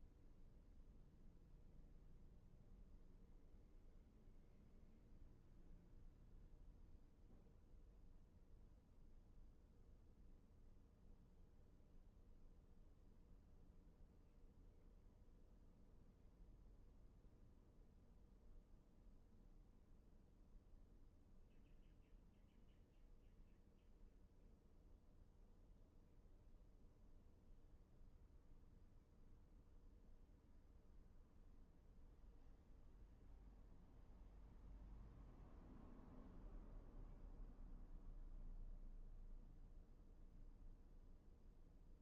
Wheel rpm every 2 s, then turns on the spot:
0, 0, 0, 0, 0, 0, 0, 0, 0, 0, 0, 0, 0, 0, 0, 0, 0, 0, 0, 0, 0.
none